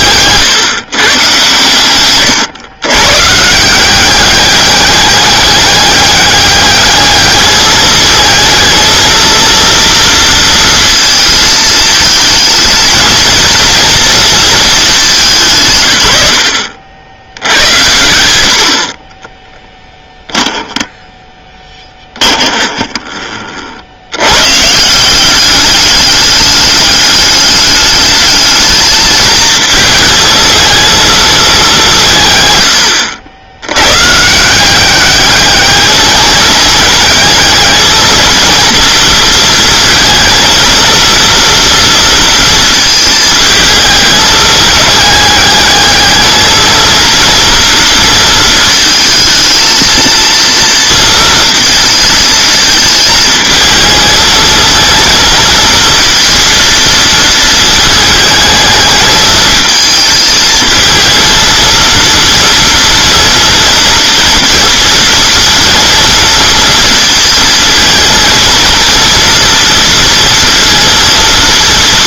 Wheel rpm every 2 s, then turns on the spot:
150, 110, 200, 210, 220, 230, 220, 210, 80, 50, 10, 20, 150, 200, 220, 220, 110, 180, 210, 230, 230, 230, 220, 230, 220, 230, 220, 220, 230, 220, 230, 230, 230, 230, 230, 230.
22-24